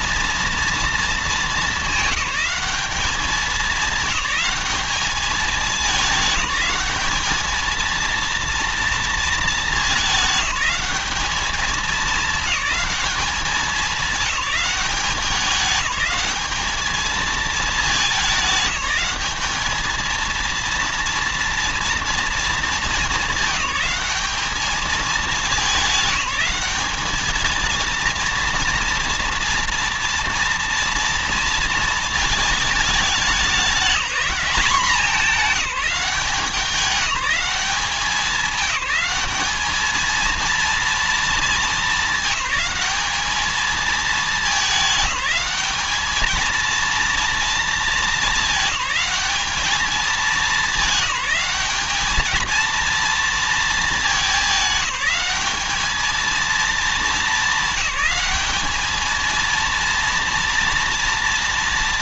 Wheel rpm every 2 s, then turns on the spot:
220, 200, 210, 210, 220, 210, 210, 200, 210, 200, 230, 200, 210, 210, 230, 230, 210, 210, 190, 210, 220, 210, 200, 230, 210, 200, 230, 210, 220, 220, 220.
none